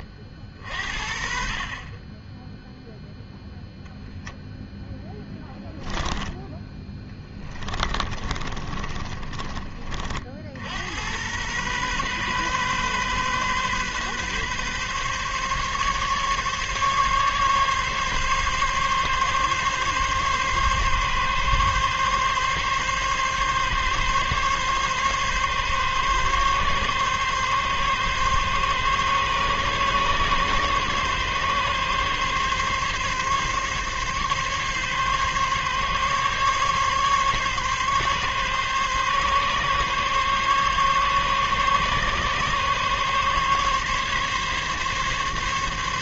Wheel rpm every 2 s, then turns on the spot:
50, 0, 0, 20, 30, 80, 130, 130, 140, 140, 140, 140, 140, 140, 140, 140, 140, 140, 140, 140, 140, 140, 140.
6-10